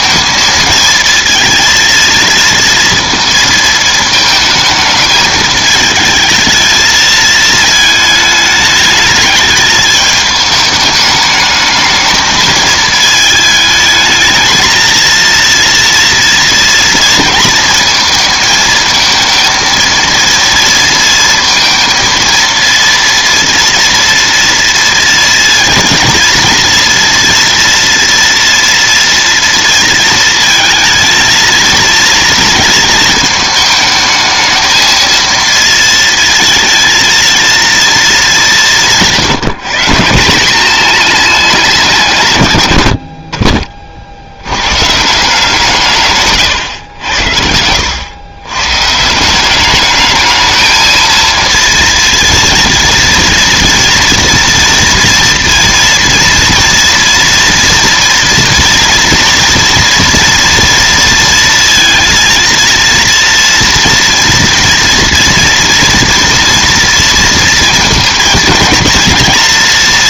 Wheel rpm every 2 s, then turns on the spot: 220, 230, 220, 220, 210, 210, 220, 230, 230, 230, 230, 230, 230, 230, 230, 220, 230, 220, 230, 180, 200, 110, 110, 120, 120, 220, 230, 230, 240, 230, 230, 230, 230, 230, 230.
none